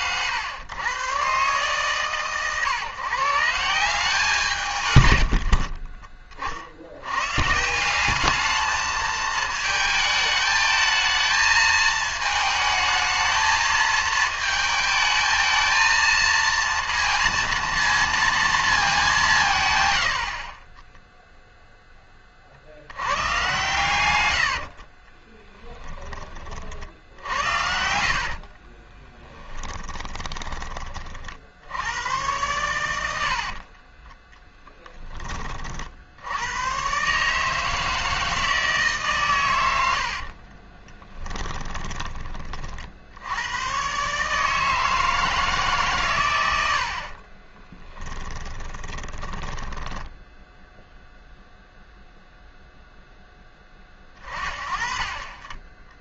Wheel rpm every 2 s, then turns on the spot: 120, 130, 130, 70, 220, 220, 220, 220, 230, 210, 10, 70, 50, 60, 30, 20, 100, 10, 120, 150, 20, 50, 160, 70, 20, 0, 0, 40.
20-22 24-26 28-30 40-42 48-50